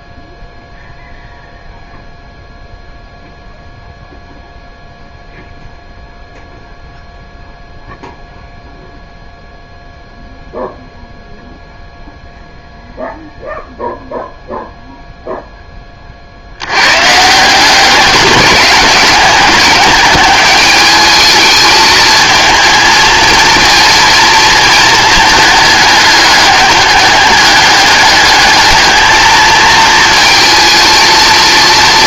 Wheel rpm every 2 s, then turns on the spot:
0, 0, 0, 0, 0, 0, 0, 0, 90, 200, 210, 220, 220, 200, 210, 220.
none